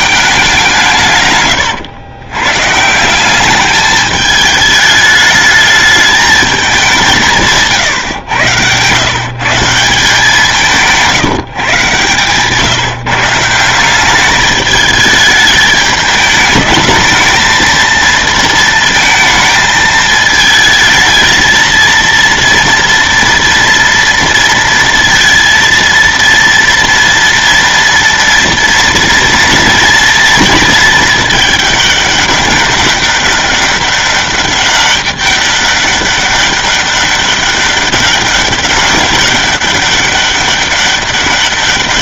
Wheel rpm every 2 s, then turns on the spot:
160, 160, 210, 190, 120, 170, 150, 210, 220, 220, 220, 230, 230, 230, 230, 220, 200, 200, 200, 200, 200.
none